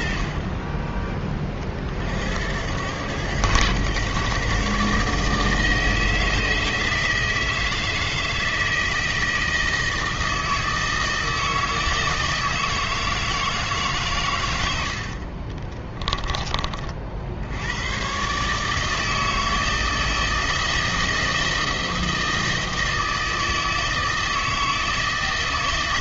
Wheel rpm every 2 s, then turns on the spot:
30, 90, 140, 160, 160, 160, 160, 100, 30, 150, 160, 160, 160.
none